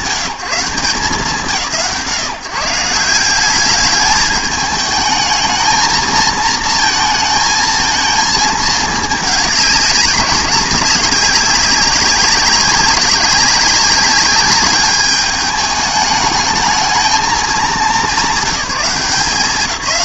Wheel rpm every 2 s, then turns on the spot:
160, 160, 210, 220, 220, 200, 200, 200, 220, 190.
none